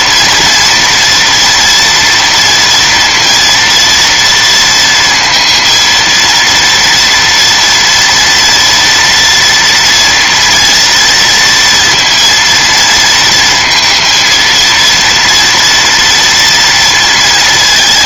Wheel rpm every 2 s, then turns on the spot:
230, 230, 230, 230, 240, 230, 230, 230, 230.
none